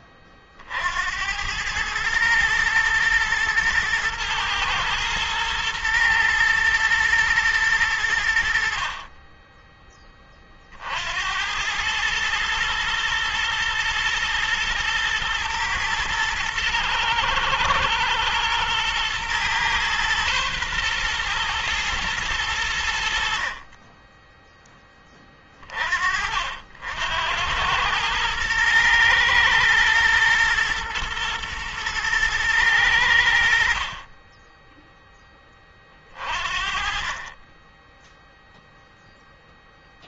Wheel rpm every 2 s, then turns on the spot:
70, 120, 120, 110, 30, 60, 110, 120, 110, 120, 120, 70, 20, 80, 120, 110, 90, 10, 30, 0.
none